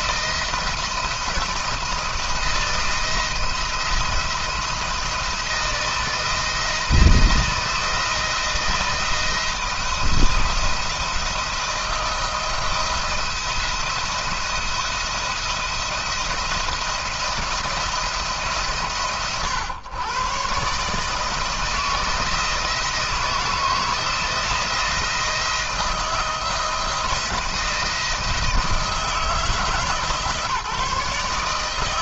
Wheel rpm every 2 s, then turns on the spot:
170, 160, 170, 160, 170, 170, 160, 170, 170, 140, 140, 160, 170, 160, 160, 150.
none